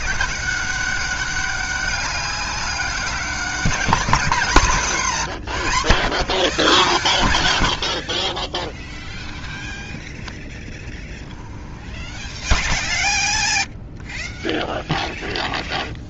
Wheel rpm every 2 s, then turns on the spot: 190, 200, 180, 130, 30, 20, 20, 0.
8-10 12-14